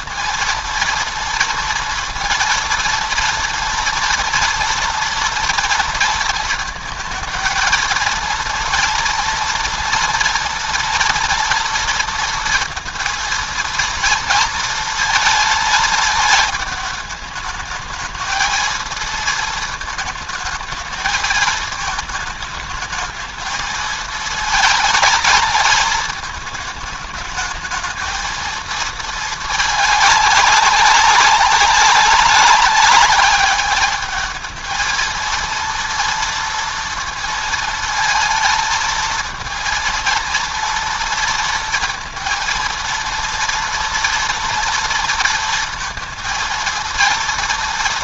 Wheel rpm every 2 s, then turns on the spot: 230, 230, 230, 220, 230, 230, 230, 230, 220, 230, 220, 220, 220, 210, 220, 200, 200, 220, 230, 220, 230, 230, 230, 230.
none